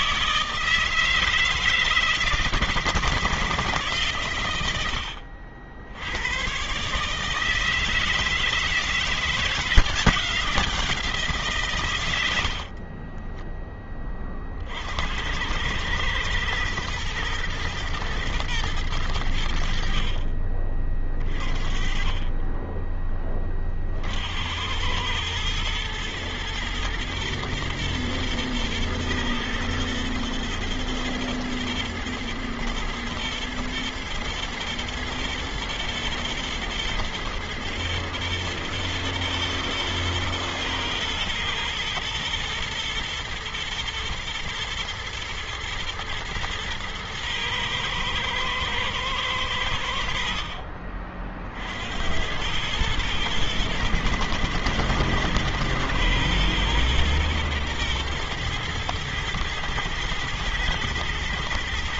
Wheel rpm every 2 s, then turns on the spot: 160, 160, 100, 130, 160, 180, 60, 60, 110, 110, 40, 20, 90, 120, 120, 110, 110, 120, 120, 110, 110, 110, 110, 110, 110, 40, 100, 110, 120, 120, 120.
12-14